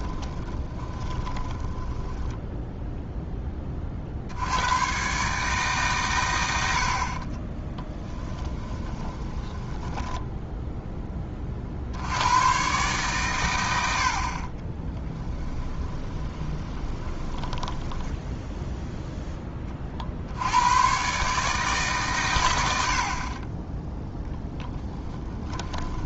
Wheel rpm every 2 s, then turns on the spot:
20, 0, 110, 70, 20, 10, 120, 20, 20, 0, 110, 70, 10.
0-2 8-10 14-18 24-26